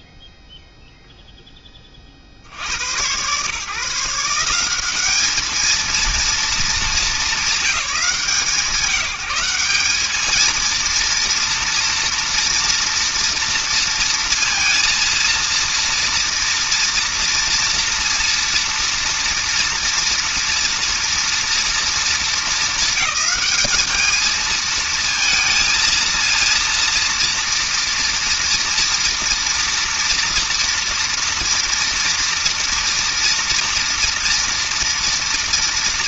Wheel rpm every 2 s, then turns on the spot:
0, 0, 120, 210, 210, 190, 230, 230, 230, 230, 230, 230, 200, 220, 230, 230, 240, 230.
none